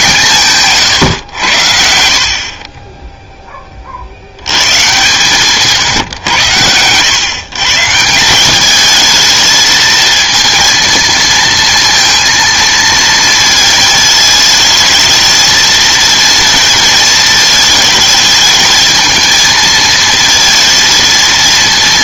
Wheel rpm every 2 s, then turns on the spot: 140, 30, 110, 100, 210, 230, 230, 220, 220, 220, 230.
none